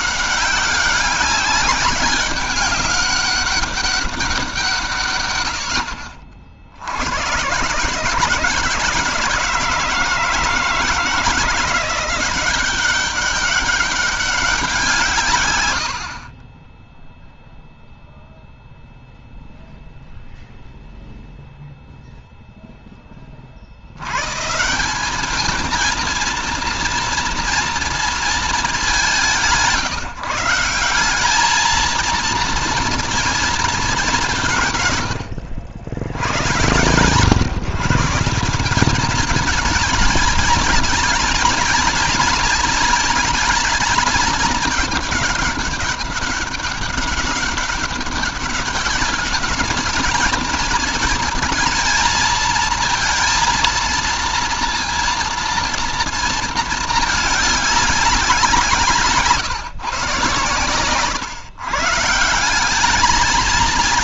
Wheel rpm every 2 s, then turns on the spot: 200, 200, 180, 50, 160, 160, 180, 200, 40, 0, 0, 0, 130, 230, 220, 160, 230, 170, 110, 180, 220, 230, 210, 200, 200, 220, 230, 230, 230, 190, 130, 170.
none